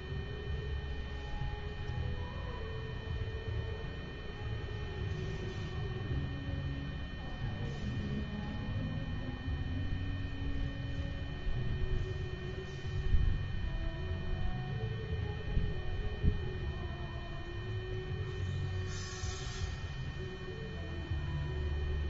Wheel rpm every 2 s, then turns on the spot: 0, 0, 0, 0, 0, 0, 0, 0, 0, 0, 0.
none